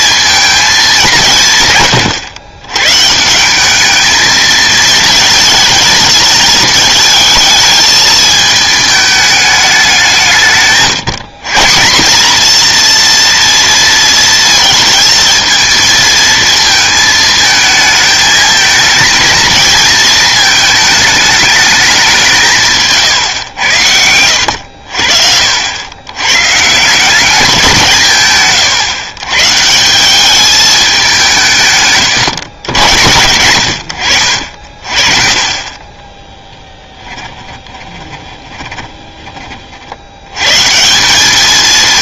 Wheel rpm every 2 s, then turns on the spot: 220, 110, 220, 220, 220, 150, 230, 230, 220, 220, 220, 160, 80, 140, 140, 210, 110, 40, 10, 20, 140.
36-40